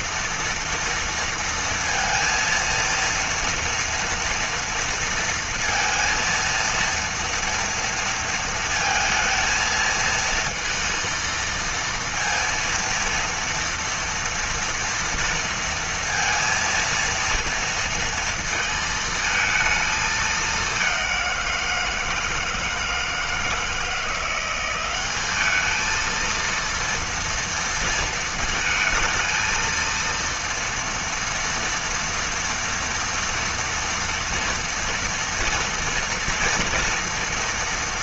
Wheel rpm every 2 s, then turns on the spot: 230, 230, 230, 230, 220, 230, 230, 230, 230, 220, 190, 160, 190, 230, 220, 230, 230, 230, 230.
none